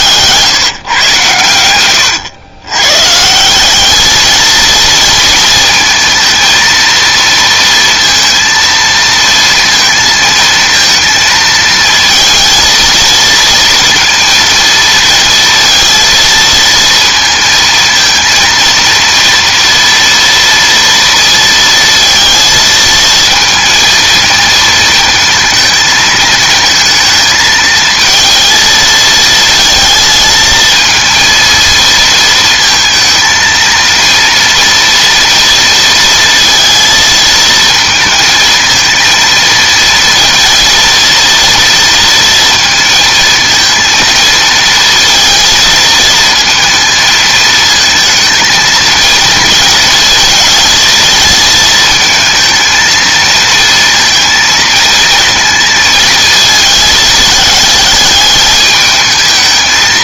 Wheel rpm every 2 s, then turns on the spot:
150, 120, 230, 230, 230, 220, 230, 230, 230, 230, 230, 230, 220, 220, 230, 230, 230, 230, 230, 220, 230, 230, 230, 220, 230, 220, 230, 230, 220, 210.
none